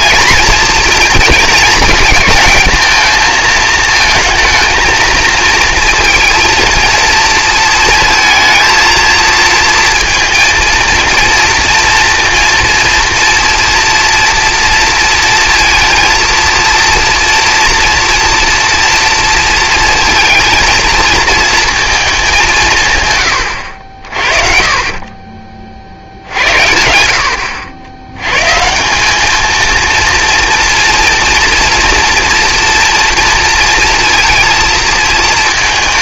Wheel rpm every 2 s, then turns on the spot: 230, 230, 230, 230, 230, 230, 230, 230, 230, 230, 220, 170, 40, 90, 140, 230, 230, 230.
none